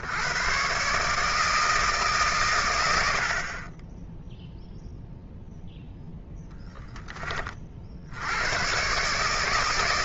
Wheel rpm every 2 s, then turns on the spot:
150, 60, 0, 60, 160.
none